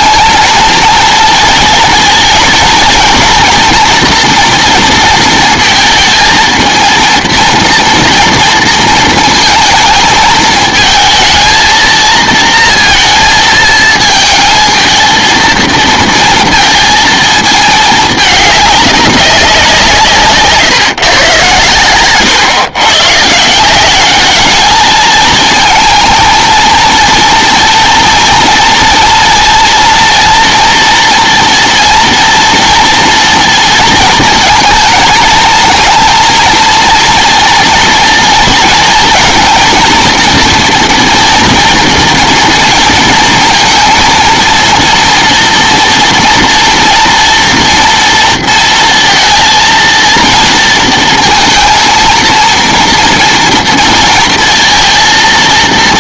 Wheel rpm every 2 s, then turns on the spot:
230, 230, 230, 230, 230, 220, 230, 220, 230, 200, 130, 120, 210, 230, 230, 230, 230, 220, 230, 230, 230, 230, 230, 240, 230, 230, 240, 230.
none